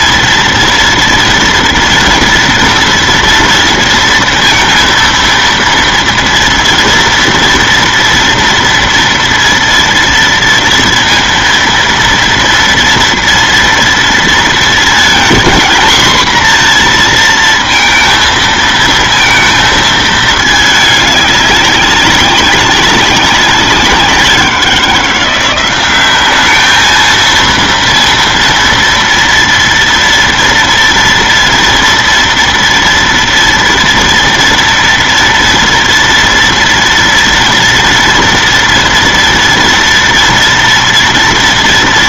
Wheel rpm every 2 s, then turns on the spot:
240, 230, 230, 230, 230, 230, 230, 230, 230, 230, 210, 200, 180, 220, 230, 230, 230, 230, 230, 230, 230.
none